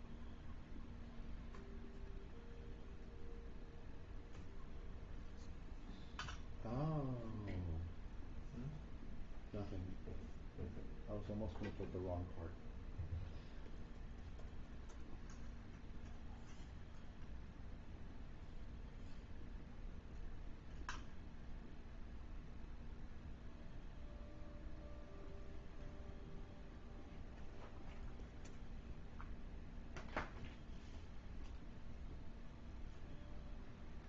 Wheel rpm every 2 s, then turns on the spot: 0, 0, 0, 0, 0, 0, 0, 0, 0, 0, 0, 0, 0, 0, 0, 0, 0.
none